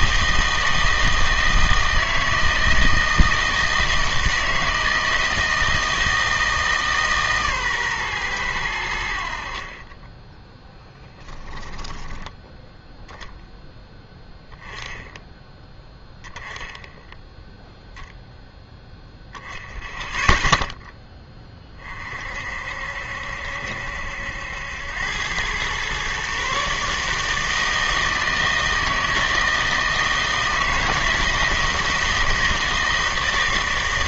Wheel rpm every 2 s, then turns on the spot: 160, 160, 160, 160, 90, 10, 0, 10, 10, 0, 0, 60, 80, 140, 160, 160, 160.
10-12